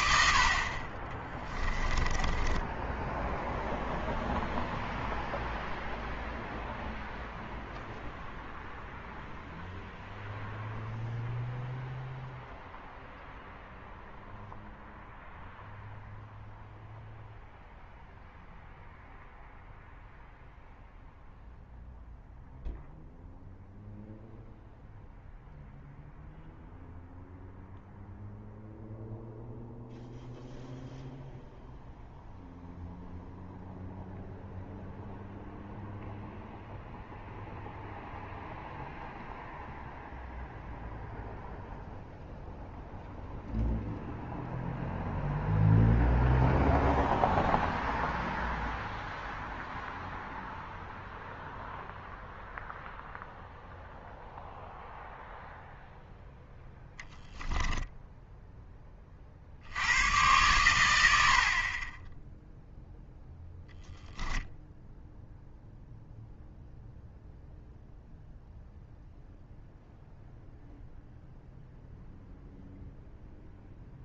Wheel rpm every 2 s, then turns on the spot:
40, 10, 0, 0, 0, 0, 0, 0, 0, 0, 0, 0, 0, 0, 0, 0, 0, 0, 0, 0, 0, 0, 0, 0, 0, 0, 0, 0, 0, 20, 100, 0, 0, 0, 0, 0, 0.
2-4